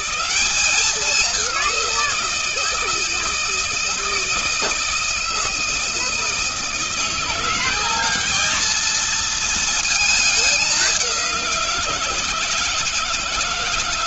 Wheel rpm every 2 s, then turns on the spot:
200, 160, 160, 170, 220, 190, 160.
none